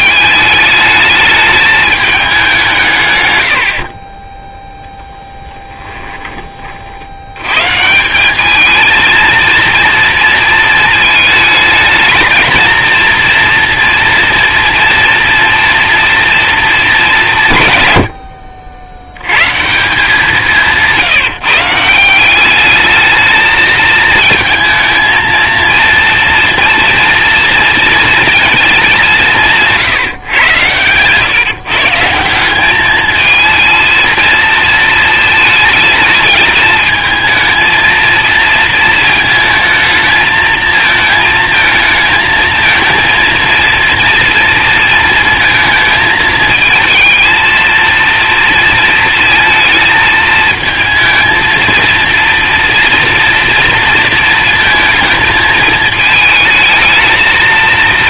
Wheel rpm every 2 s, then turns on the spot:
210, 190, 10, 30, 210, 230, 220, 230, 230, 60, 170, 200, 220, 240, 220, 110, 190, 230, 220, 230, 220, 220, 230, 220, 230, 220, 230, 220, 220.
none